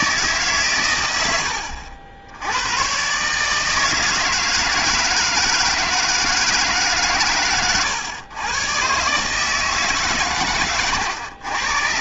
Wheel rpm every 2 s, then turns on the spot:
140, 90, 160, 160, 120, 120.
none